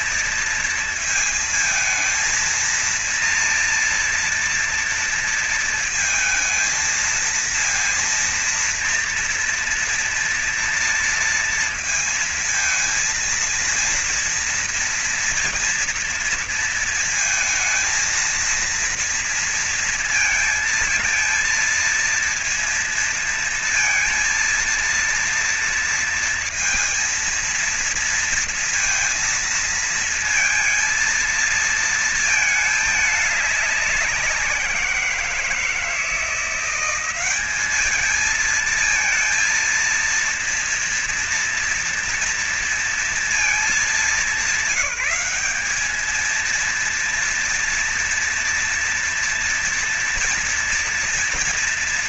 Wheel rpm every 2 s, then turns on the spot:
230, 230, 230, 230, 230, 230, 230, 230, 230, 230, 230, 230, 230, 230, 230, 230, 220, 190, 170, 210, 230, 240, 200, 220, 240, 240.
none